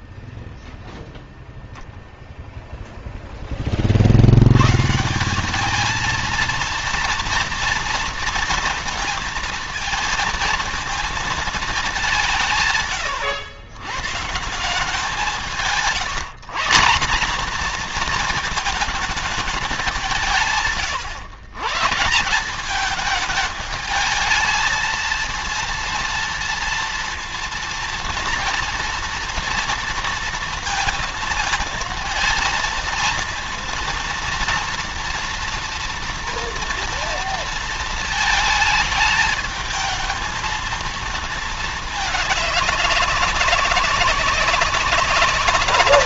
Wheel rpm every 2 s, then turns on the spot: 0, 0, 150, 230, 230, 230, 130, 180, 210, 220, 140, 200, 230, 230, 230, 230, 230, 230, 230, 210, 230, 200, 190.
none